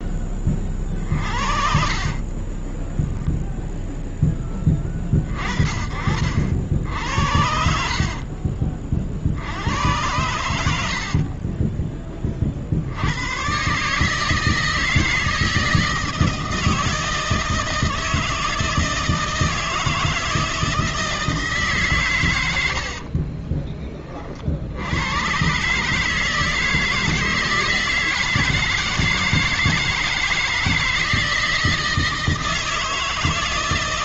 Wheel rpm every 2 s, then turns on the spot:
20, 30, 30, 60, 50, 90, 40, 150, 160, 160, 160, 100, 50, 160, 160, 160, 160.
2-4 8-12